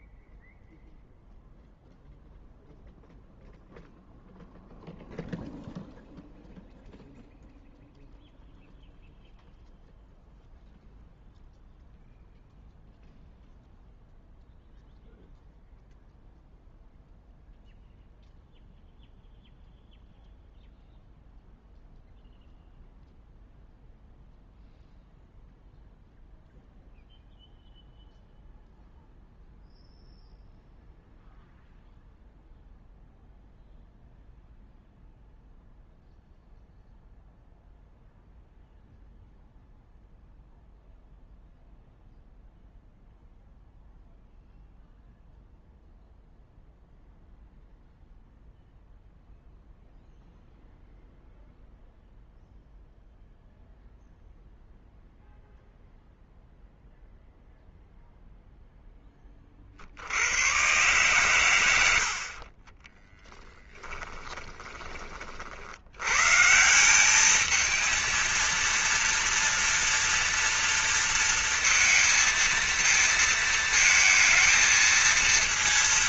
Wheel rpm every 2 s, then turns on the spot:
0, 0, 0, 0, 0, 0, 0, 0, 0, 0, 0, 0, 0, 0, 0, 0, 0, 0, 0, 0, 0, 0, 0, 0, 0, 0, 0, 0, 0, 10, 120, 20, 20, 180, 230, 230, 230, 230.
62-64